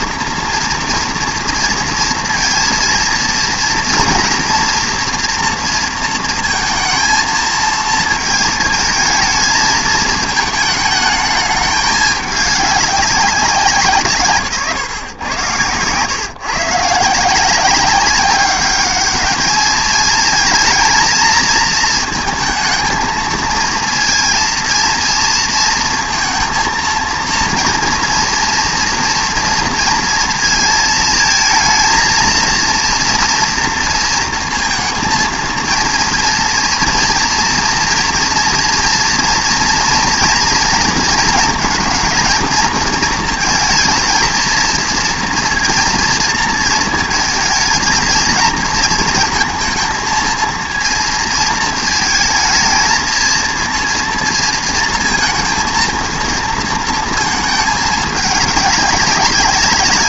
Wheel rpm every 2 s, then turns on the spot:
230, 230, 230, 230, 220, 220, 200, 140, 140, 210, 220, 220, 230, 230, 240, 220, 230, 230, 230, 230, 230, 220, 230, 230, 220, 230, 220, 230, 230, 200.
none